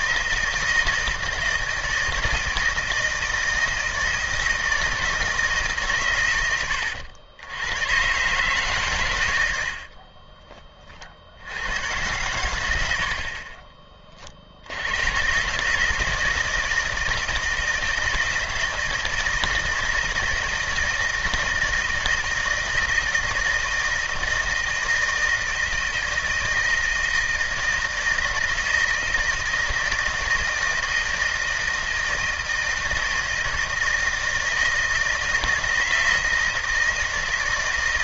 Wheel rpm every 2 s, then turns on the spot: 160, 160, 160, 90, 140, 30, 80, 90, 160, 160, 160, 160, 170, 160, 160, 160, 160, 160, 160.
none